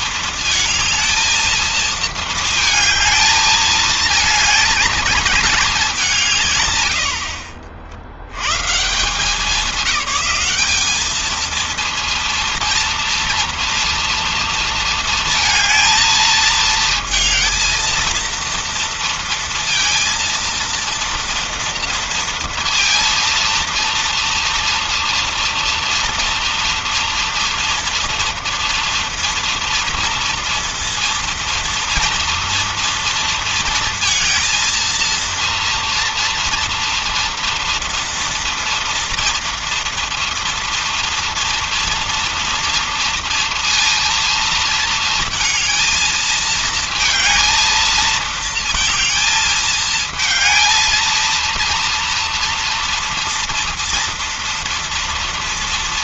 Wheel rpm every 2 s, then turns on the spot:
220, 220, 230, 150, 120, 190, 230, 230, 220, 230, 230, 230, 230, 230, 230, 230, 230, 230, 230, 230, 230, 230, 230, 220, 220, 220, 230, 230.
none